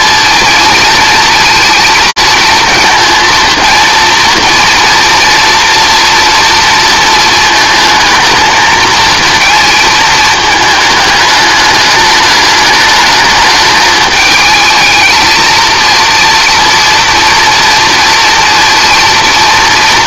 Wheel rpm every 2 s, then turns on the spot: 230, 220, 230, 230, 220, 220, 210, 210, 230, 230.
none